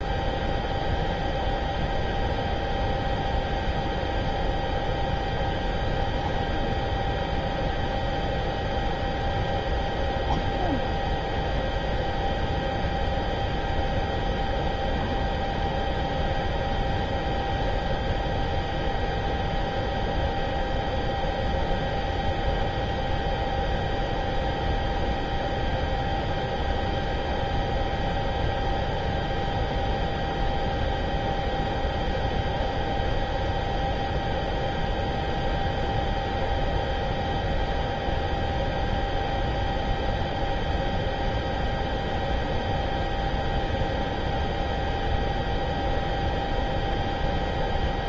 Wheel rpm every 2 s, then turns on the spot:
0, 0, 0, 0, 0, 0, 0, 0, 0, 0, 0, 0, 0, 0, 0, 0, 0, 0, 0, 0, 0, 0, 0, 0.
none